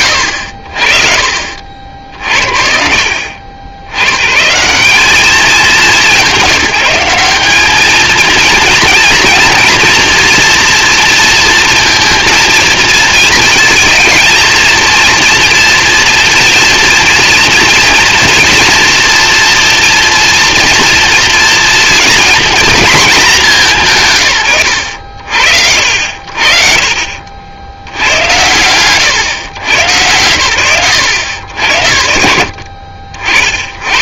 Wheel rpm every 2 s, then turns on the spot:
60, 70, 170, 190, 230, 230, 230, 230, 230, 230, 230, 220, 110, 60, 100, 70, 70.
24-26